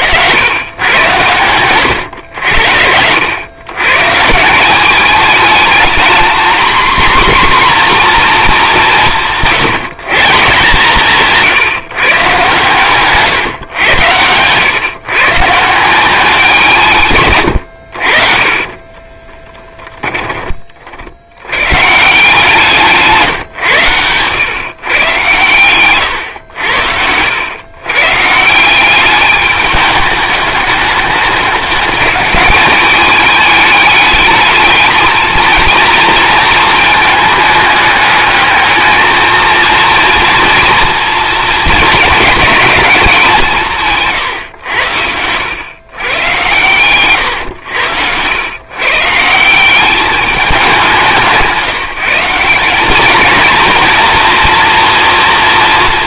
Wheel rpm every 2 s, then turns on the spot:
110, 80, 190, 240, 200, 150, 140, 120, 160, 30, 50, 160, 130, 80, 180, 210, 210, 220, 220, 220, 240, 200, 100, 130, 130, 190, 200, 240.
18-20